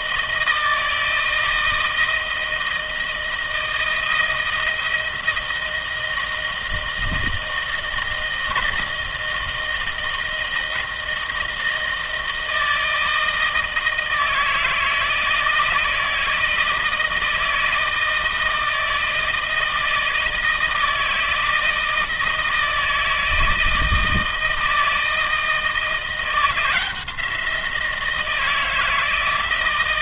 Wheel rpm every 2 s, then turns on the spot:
160, 160, 160, 160, 160, 160, 160, 160, 160, 160, 160, 160, 160, 170, 160.
none